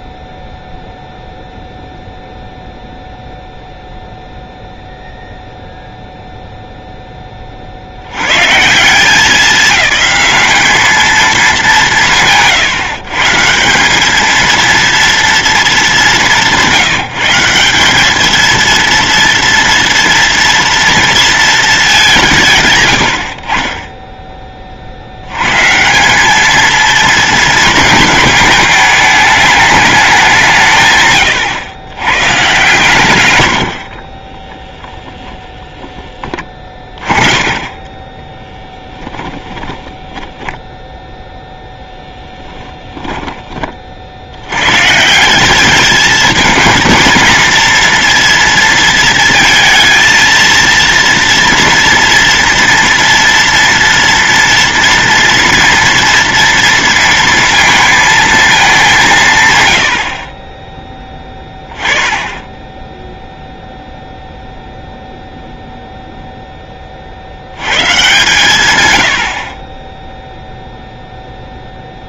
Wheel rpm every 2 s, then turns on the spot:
0, 0, 0, 0, 140, 200, 150, 230, 170, 230, 230, 120, 50, 230, 210, 140, 130, 10, 20, 10, 0, 10, 140, 220, 230, 230, 230, 240, 230, 210, 20, 10, 0, 30, 110, 0.
36-40 42-44